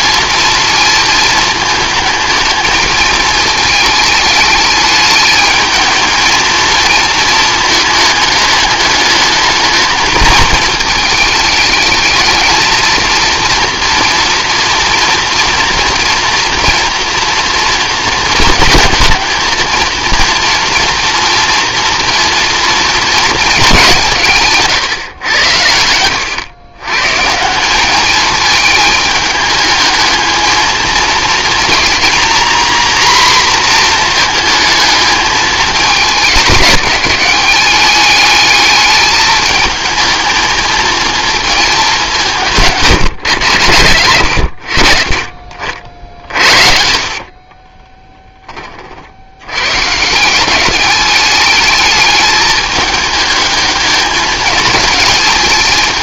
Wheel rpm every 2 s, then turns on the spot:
230, 220, 210, 220, 210, 220, 220, 230, 230, 220, 230, 230, 150, 110, 220, 230, 250, 220, 210, 210, 230, 160, 80, 60, 30, 190, 210, 220.
46-48